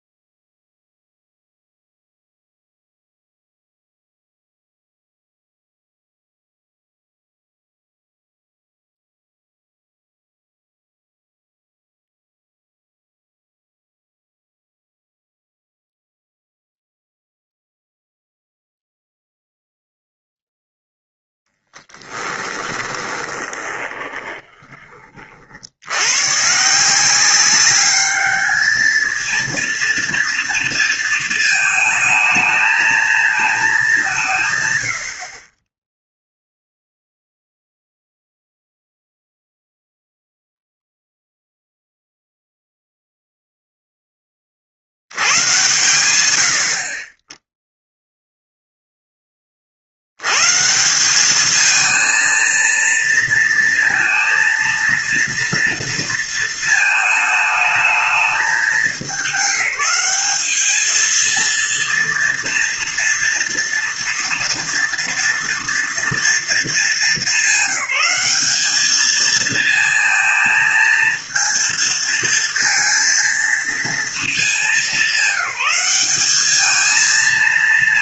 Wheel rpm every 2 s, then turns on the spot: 0, 0, 0, 0, 0, 0, 0, 0, 0, 0, 0, 20, 20, 140, 210, 230, 220, 140, 0, 0, 0, 0, 40, 80, 0, 140, 230, 230, 230, 220, 220, 230, 230, 220, 200, 220, 230, 210, 210.
22-26